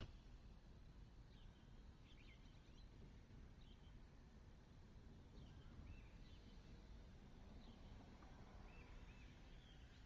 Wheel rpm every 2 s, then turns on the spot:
0, 0, 0, 0, 0.
none